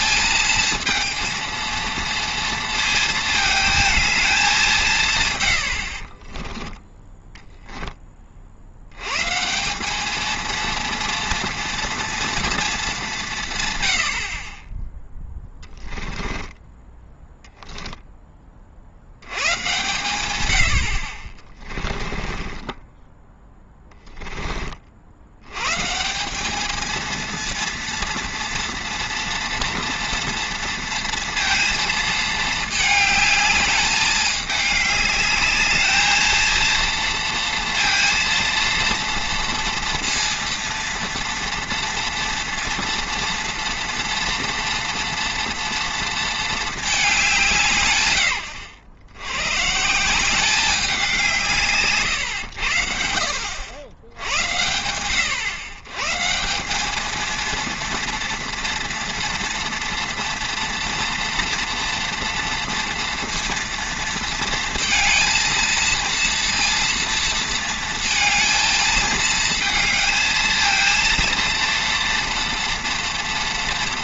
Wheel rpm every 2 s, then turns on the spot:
230, 220, 180, 20, 60, 230, 210, 10, 10, 40, 80, 20, 40, 220, 230, 230, 220, 210, 230, 230, 230, 230, 230, 220, 90, 190, 70, 80, 190, 230, 230, 230, 230, 230, 220, 230, 230.
6-8 22-24